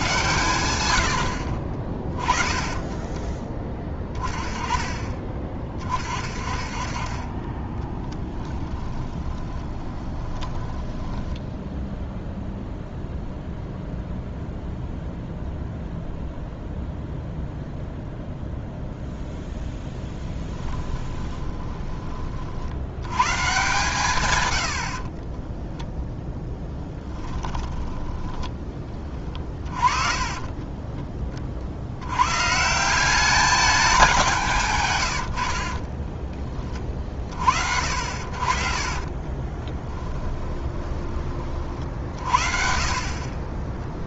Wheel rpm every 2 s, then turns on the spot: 110, 20, 30, 30, 20, 20, 0, 0, 0, 0, 20, 80, 70, 10, 20, 20, 160, 140, 30, 50, 20, 50.
8-12 20-22 26-32 38-42